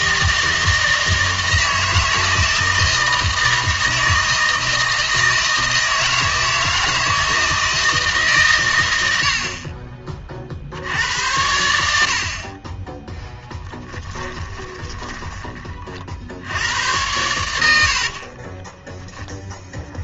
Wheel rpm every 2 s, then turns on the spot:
160, 160, 160, 160, 110, 60, 20, 10, 90, 10.
14-16 18-20